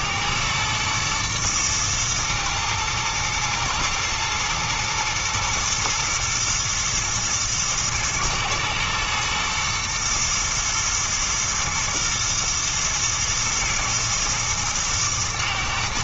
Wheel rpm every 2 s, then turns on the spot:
110, 120, 110, 120, 110, 110, 110, 110.
none